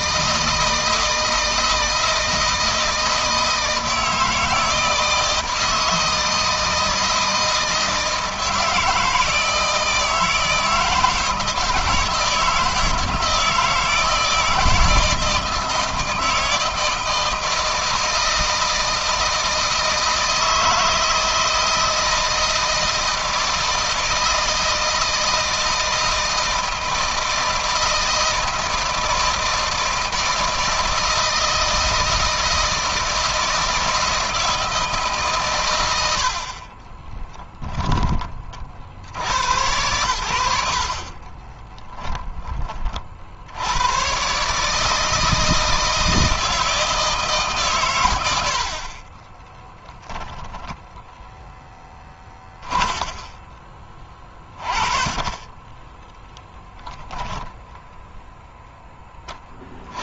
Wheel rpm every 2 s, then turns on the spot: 160, 160, 160, 160, 160, 160, 160, 160, 160, 160, 160, 160, 160, 160, 160, 160, 160, 150, 20, 60, 50, 40, 160, 160, 40, 0, 30, 30, 10, 0.
36-38 40-42 52-56